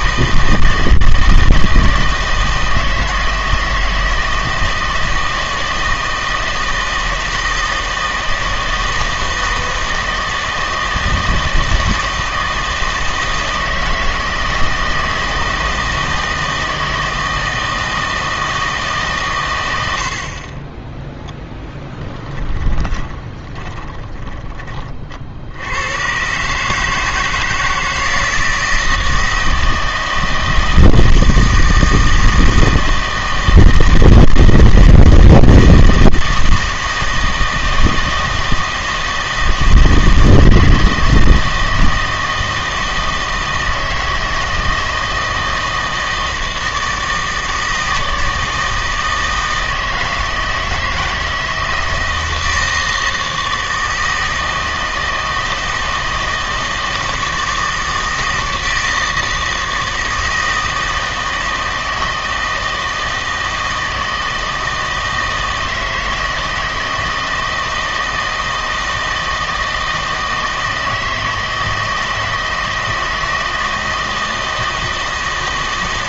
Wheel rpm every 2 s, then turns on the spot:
160, 160, 160, 160, 160, 160, 160, 160, 160, 160, 20, 20, 30, 150, 160, 160, 160, 160, 160, 160, 160, 160, 160, 160, 160, 160, 160, 160, 160, 160, 160, 160, 160, 160, 160, 160, 160, 160.
22-24